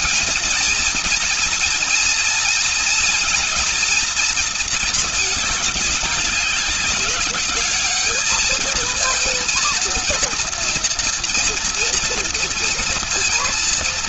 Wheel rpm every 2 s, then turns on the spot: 230, 230, 220, 200, 230, 230, 230.
none